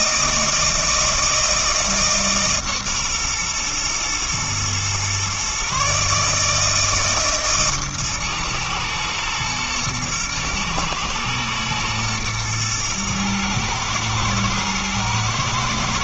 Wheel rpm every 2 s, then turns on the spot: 160, 140, 120, 160, 120, 120, 120, 110.
none